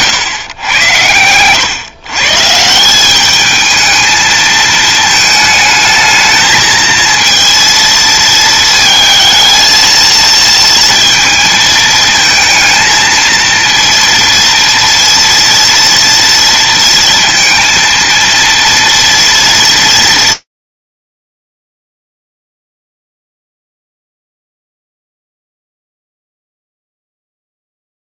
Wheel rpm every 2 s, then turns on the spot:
100, 200, 220, 230, 220, 230, 230, 230, 230, 230, 30, 0, 0, 0.
none